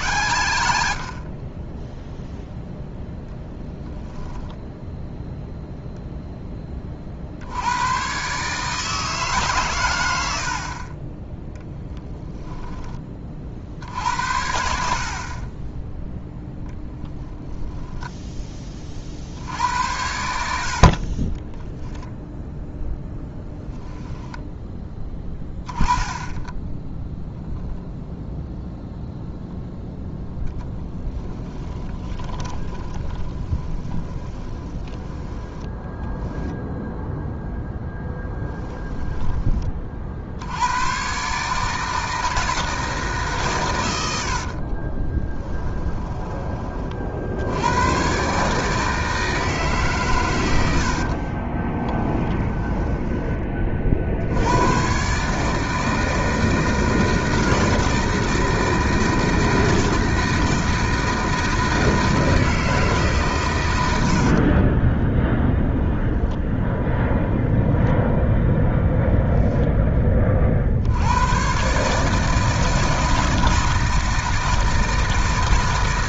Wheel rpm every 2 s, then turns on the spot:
50, 10, 10, 20, 150, 30, 20, 60, 0, 30, 50, 10, 10, 10, 0, 20, 20, 20, 0, 10, 100, 160, 30, 30, 150, 80, 10, 120, 160, 160, 160, 150, 20, 0, 0, 60, 160, 160.
30-36 38-40 44-46 52-54 64-66